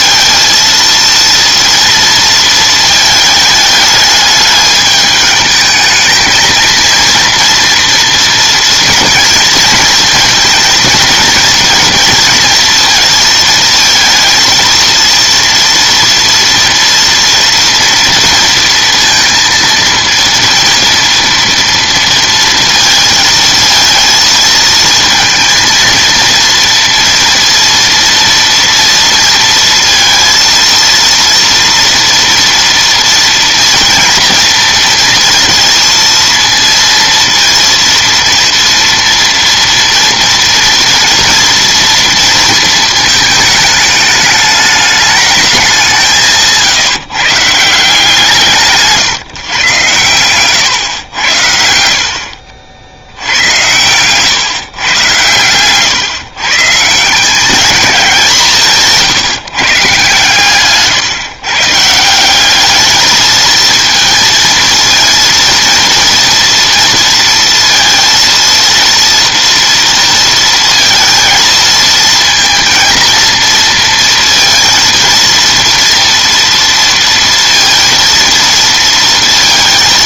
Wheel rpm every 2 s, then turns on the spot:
230, 220, 210, 220, 230, 230, 230, 230, 230, 230, 230, 220, 230, 230, 230, 230, 230, 230, 230, 240, 230, 220, 210, 160, 160, 120, 60, 140, 160, 160, 140, 200, 220, 230, 230, 230, 230, 230, 230, 230.
none